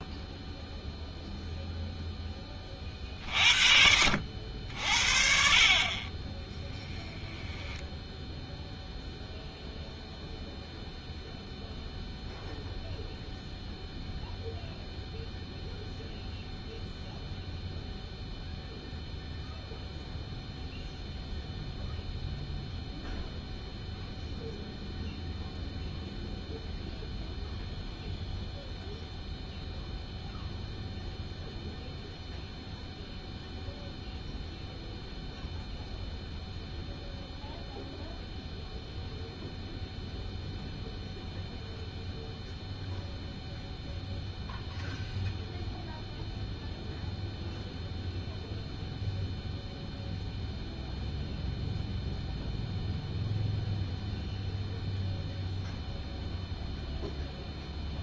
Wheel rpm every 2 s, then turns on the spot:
0, 40, 50, 10, 0, 0, 0, 0, 0, 0, 0, 0, 0, 0, 0, 0, 0, 0, 0, 0, 0, 0, 0, 0, 0, 0, 0, 0, 0.
none